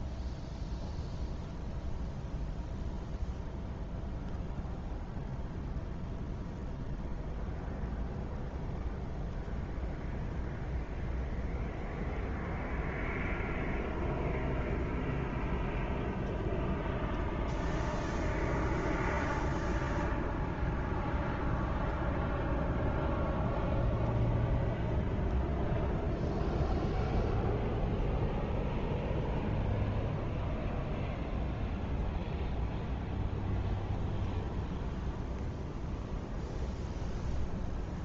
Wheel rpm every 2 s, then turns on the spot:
0, 0, 0, 0, 0, 0, 0, 0, 0, 0, 0, 0, 0, 0, 0, 0, 0, 0, 0.
none